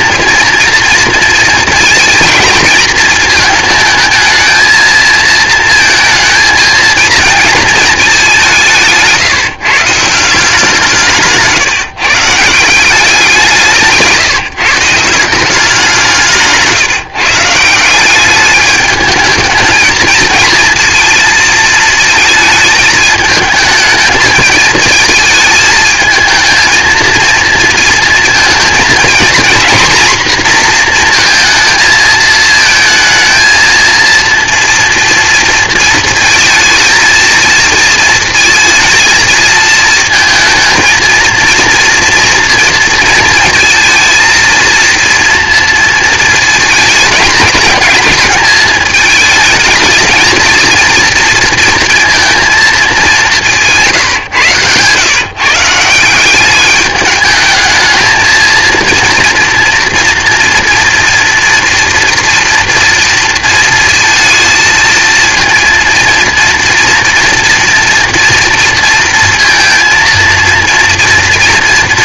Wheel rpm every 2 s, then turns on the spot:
230, 220, 220, 230, 170, 180, 170, 160, 160, 210, 230, 230, 230, 220, 230, 240, 220, 230, 230, 230, 230, 230, 230, 220, 220, 220, 220, 120, 200, 230, 240, 230, 220, 230, 230, 230.
none